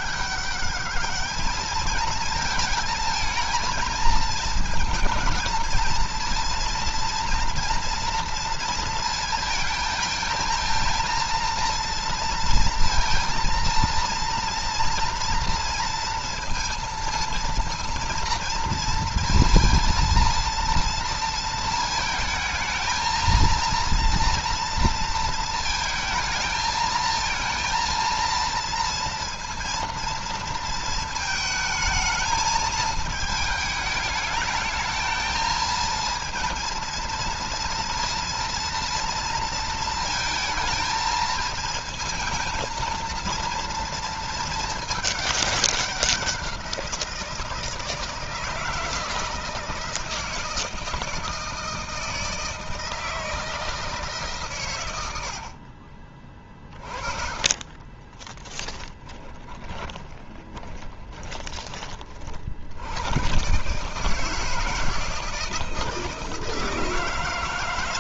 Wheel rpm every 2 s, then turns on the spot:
210, 220, 220, 230, 230, 220, 230, 230, 230, 230, 230, 220, 230, 220, 230, 230, 220, 220, 230, 230, 220, 230, 210, 180, 160, 160, 160, 100, 30, 20, 10, 90, 160, 160.
56-62